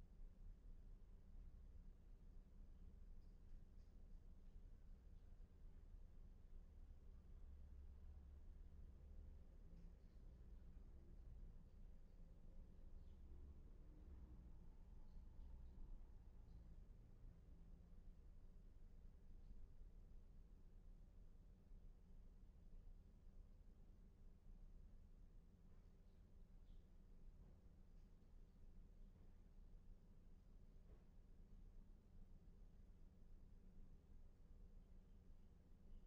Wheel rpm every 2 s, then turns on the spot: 0, 0, 0, 0, 0, 0, 0, 0, 0, 0, 0, 0, 0, 0, 0, 0, 0, 0.
none